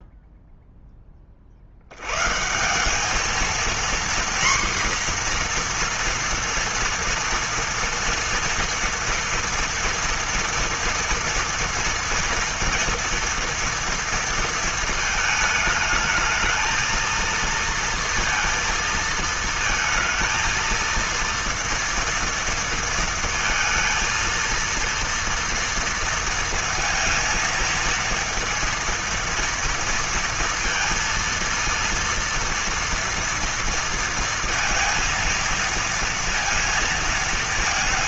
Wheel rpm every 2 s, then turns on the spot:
0, 160, 250, 230, 230, 230, 230, 230, 220, 230, 230, 230, 230, 230, 230, 230, 230, 230, 230.
none